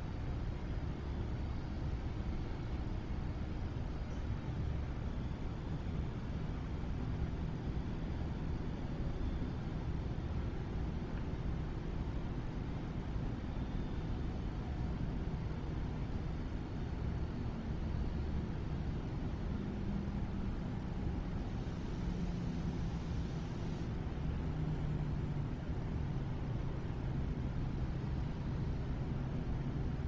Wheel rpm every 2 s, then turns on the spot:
0, 0, 0, 0, 0, 0, 0, 0, 0, 0, 0, 0, 0, 0, 0.
none